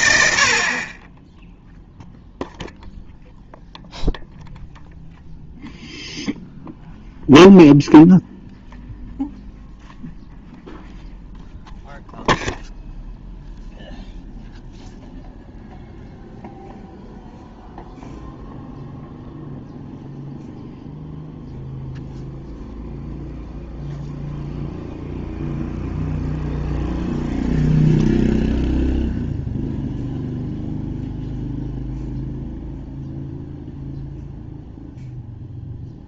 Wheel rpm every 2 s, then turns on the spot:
50, 0, 0, 0, 0, 0, 0, 0, 0, 0, 0, 0, 0, 0, 0, 0, 0, 0.
none